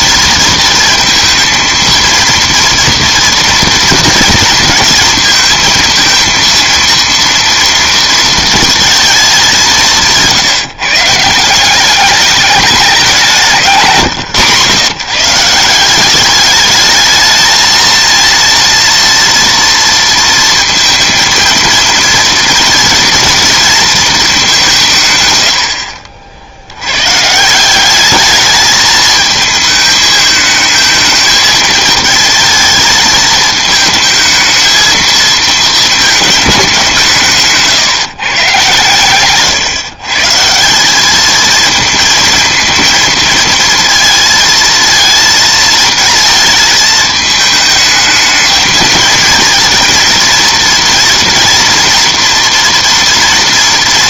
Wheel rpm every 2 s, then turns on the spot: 230, 230, 230, 230, 220, 150, 200, 140, 210, 230, 230, 230, 170, 90, 210, 220, 220, 220, 190, 130, 180, 220, 230, 220, 220, 230, 230.
none